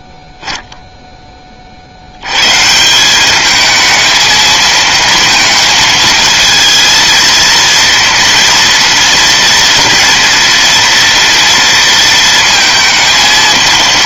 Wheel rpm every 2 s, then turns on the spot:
0, 160, 230, 230, 230, 230, 230.
none